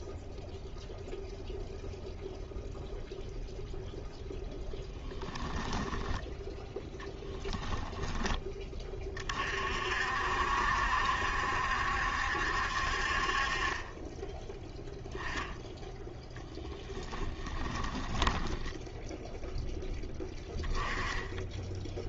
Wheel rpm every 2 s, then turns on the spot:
0, 0, 10, 10, 20, 70, 60, 10, 20, 10, 10.
16-20